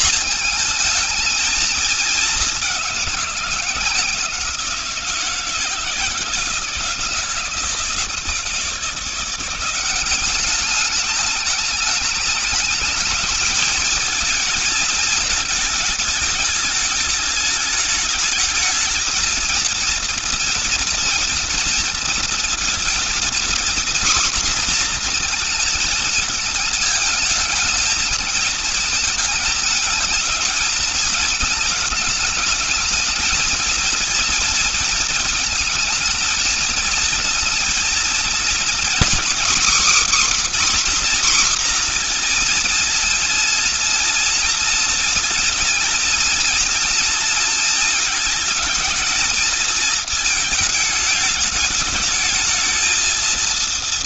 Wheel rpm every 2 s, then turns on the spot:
220, 200, 170, 160, 160, 200, 210, 230, 220, 220, 230, 230, 240, 220, 220, 220, 220, 230, 220, 230, 280, 240, 240, 240, 220, 220, 220.
none